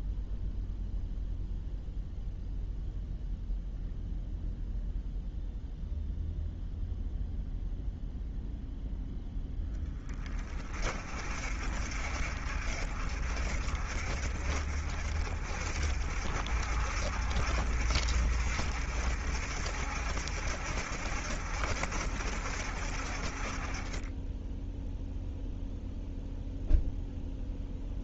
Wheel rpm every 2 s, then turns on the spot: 0, 0, 0, 0, 0, 40, 50, 50, 60, 60, 60, 50, 0, 0.
none